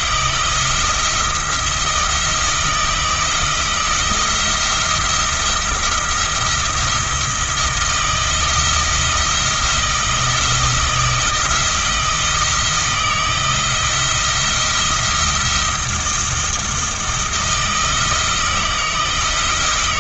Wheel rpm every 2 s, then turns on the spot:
170, 160, 170, 170, 170, 160, 160, 170, 170, 170.
none